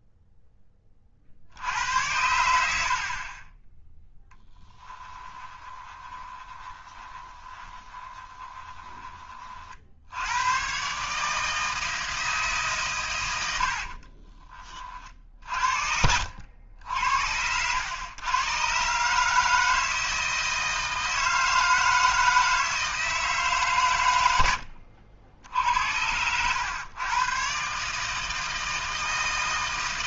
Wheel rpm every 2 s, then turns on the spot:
20, 70, 10, 20, 20, 120, 140, 40, 80, 130, 160, 160, 90, 110, 160.
4-10 24-26